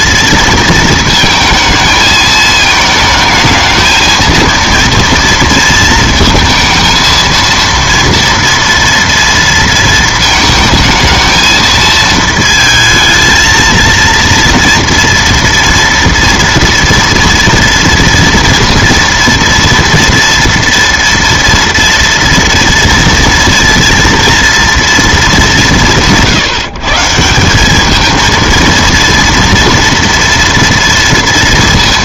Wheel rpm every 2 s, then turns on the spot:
230, 220, 230, 230, 230, 220, 220, 230, 230, 230, 230, 230, 230, 150, 230, 240.
none